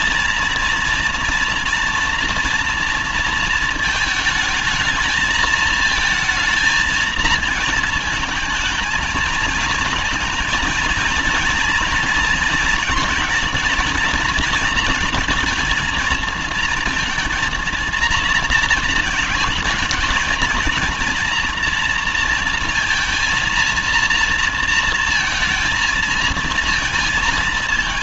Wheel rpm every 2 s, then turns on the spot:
230, 230, 220, 230, 220, 230, 240, 230, 230, 220, 230, 230, 230, 230.
none